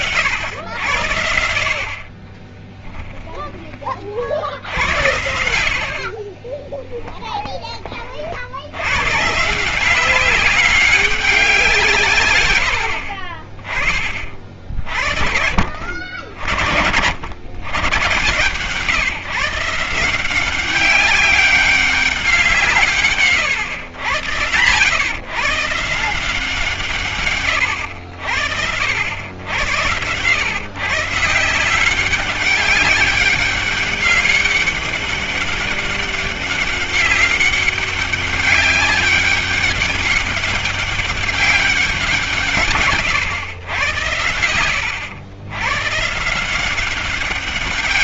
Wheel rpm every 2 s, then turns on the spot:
90, 20, 90, 20, 70, 190, 100, 50, 60, 130, 190, 170, 120, 150, 70, 130, 200, 200, 190, 200, 200, 160, 100, 170.
2-4 6-8